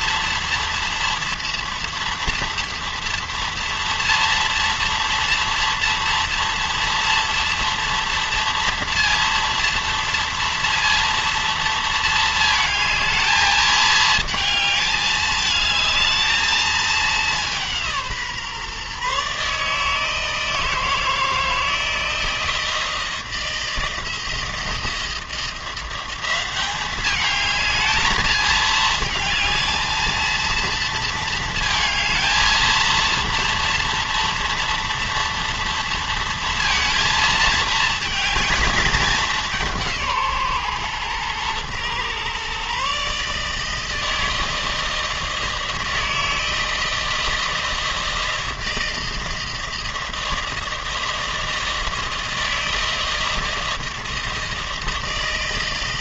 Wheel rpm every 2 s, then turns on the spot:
230, 230, 230, 230, 230, 230, 220, 220, 220, 160, 160, 160, 160, 180, 220, 220, 220, 230, 230, 220, 150, 120, 160, 160, 160, 160, 160, 160.
none